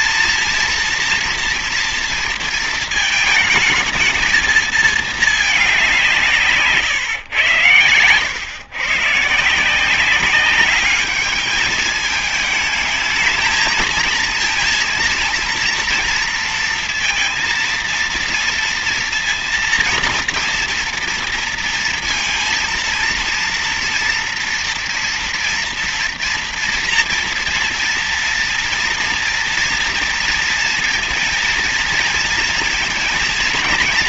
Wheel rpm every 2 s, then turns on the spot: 230, 230, 220, 130, 120, 200, 220, 230, 230, 230, 230, 230, 230, 230, 230, 230, 230.
none